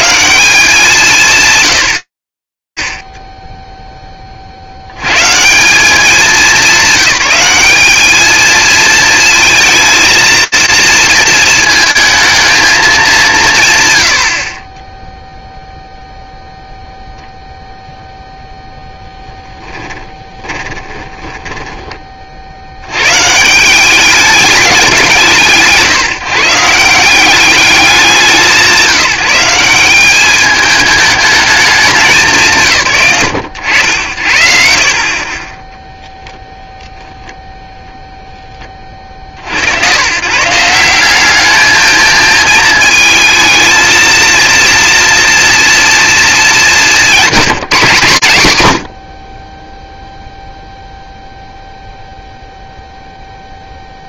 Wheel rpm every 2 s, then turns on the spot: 120, 110, 70, 210, 220, 220, 200, 10, 0, 10, 10, 170, 140, 200, 190, 210, 100, 30, 0, 50, 200, 220, 230, 180, 40, 0, 0.
18-22